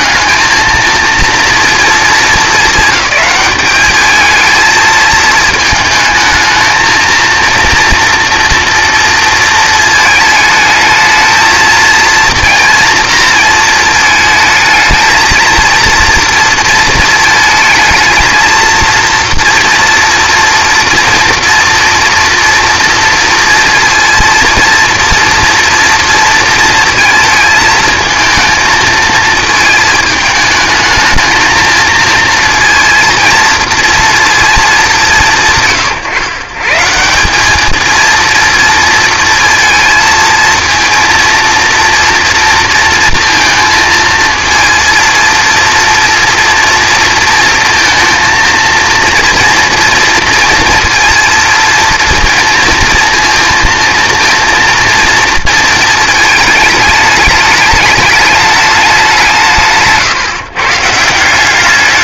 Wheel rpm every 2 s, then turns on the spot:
220, 210, 220, 220, 230, 220, 230, 220, 230, 230, 240, 230, 230, 230, 220, 220, 230, 210, 140, 230, 230, 240, 230, 230, 230, 230, 230, 230, 220, 210, 150.
none